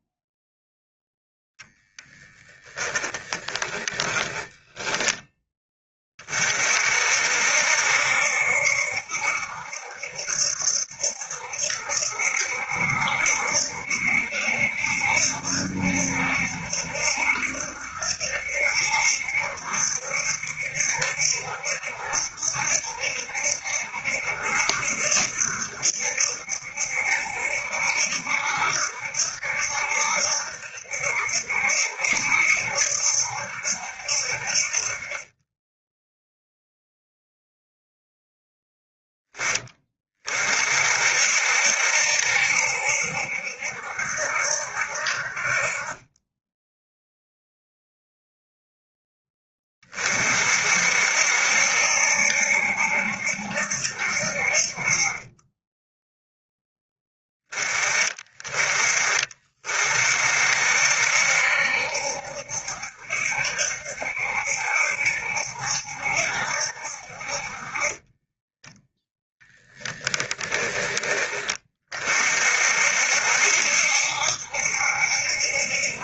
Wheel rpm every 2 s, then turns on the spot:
0, 10, 10, 50, 70, 70, 70, 70, 70, 70, 70, 70, 70, 70, 70, 70, 70, 40, 0, 10, 50, 70, 60, 0, 10, 60, 70, 50, 10, 30, 60, 70, 70, 60, 10, 20, 60, 70.
2-4